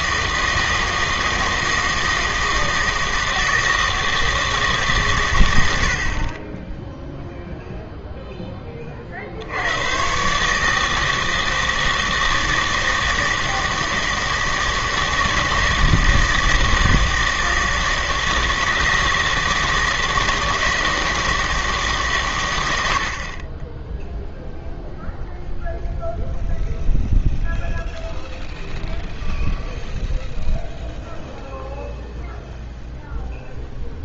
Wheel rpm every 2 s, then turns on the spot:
160, 160, 150, 10, 20, 150, 160, 160, 160, 160, 160, 100, 0, 0, 0, 0, 0.
none